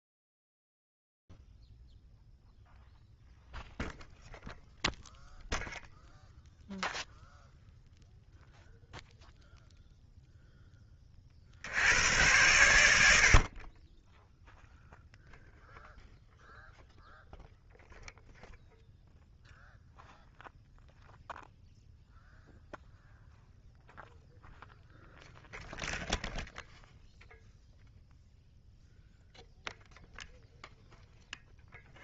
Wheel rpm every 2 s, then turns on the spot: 0, 0, 0, 0, 0, 10, 90, 0, 0, 0, 0, 0, 0, 0, 0, 0.
none